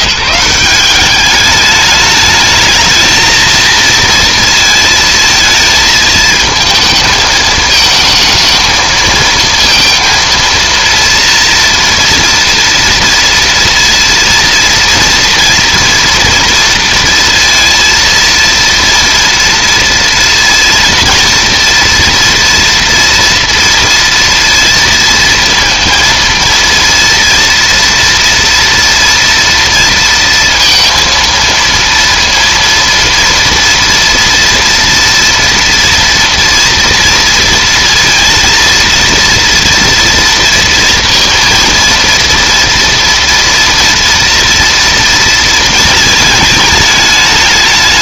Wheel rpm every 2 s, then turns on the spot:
180, 220, 230, 220, 220, 230, 230, 230, 230, 230, 230, 240, 230, 230, 230, 230, 230, 230, 230, 230, 230, 230, 230, 210.
none